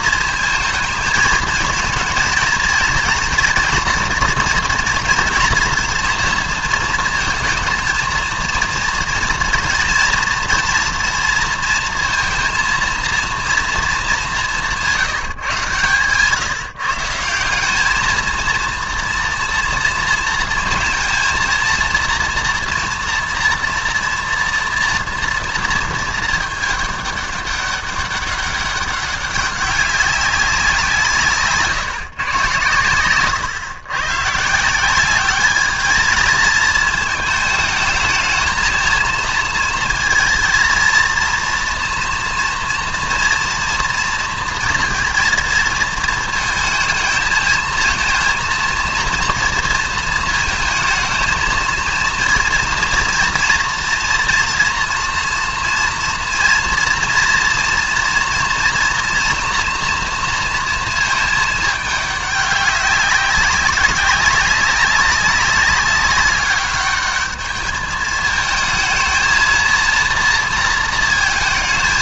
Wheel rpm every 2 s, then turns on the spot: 220, 220, 230, 230, 230, 230, 230, 180, 150, 230, 230, 230, 240, 210, 200, 180, 120, 160, 220, 220, 230, 230, 230, 220, 230, 220, 230, 240, 230, 230, 230, 200, 190, 200, 220, 230.
none